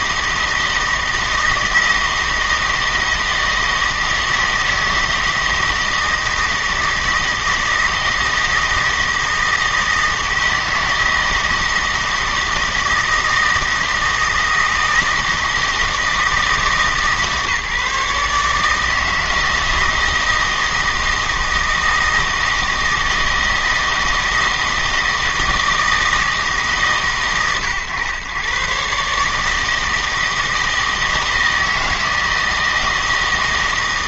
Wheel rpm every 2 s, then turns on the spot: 160, 160, 160, 160, 160, 160, 160, 160, 160, 150, 160, 160, 160, 150, 130, 160, 160.
none